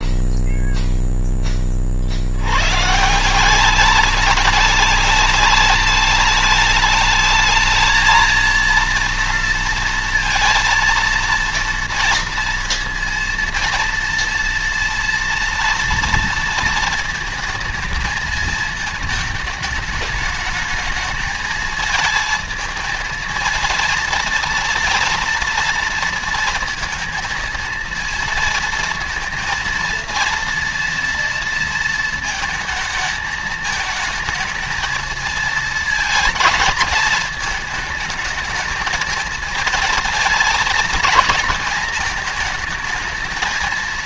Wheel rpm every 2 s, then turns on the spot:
0, 140, 210, 220, 230, 230, 230, 230, 230, 220, 220, 220, 230, 220, 230, 230, 220, 220, 230, 220, 240, 220.
none